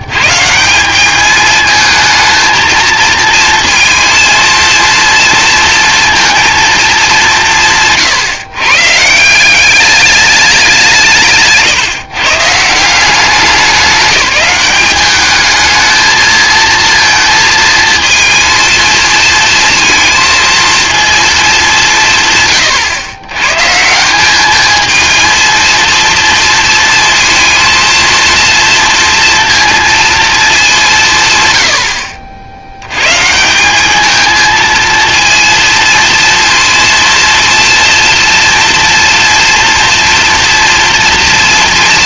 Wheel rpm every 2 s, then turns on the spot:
170, 230, 230, 220, 140, 190, 160, 200, 230, 230, 230, 120, 210, 220, 230, 200, 80, 220, 230, 240, 240.
none